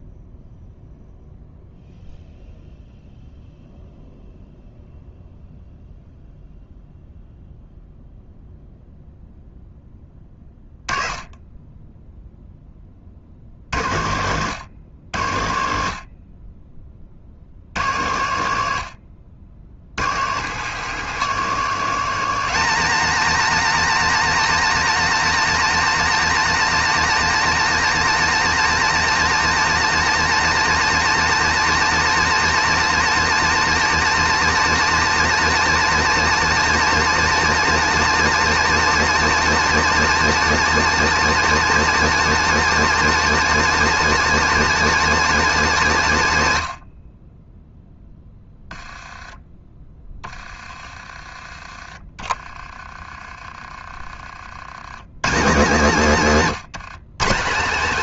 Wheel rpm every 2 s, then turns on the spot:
0, 0, 0, 0, 0, 20, 30, 100, 30, 80, 160, 250, 280, 280, 280, 280, 280, 270, 280, 280, 270, 270, 270, 100, 10, 20, 30, 90, 150.
none